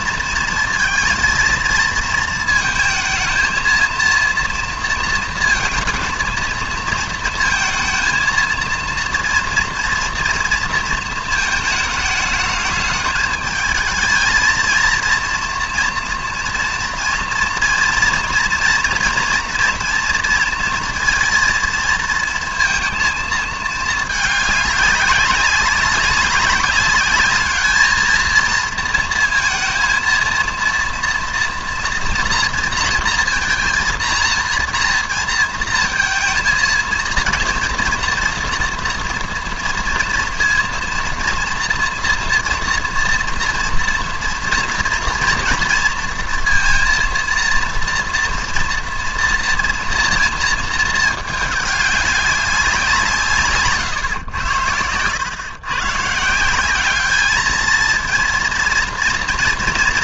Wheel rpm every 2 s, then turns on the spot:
230, 230, 230, 230, 230, 230, 210, 220, 230, 230, 240, 230, 200, 200, 230, 230, 240, 230, 230, 230, 230, 240, 230, 230, 240, 220, 170, 90, 190, 230.
none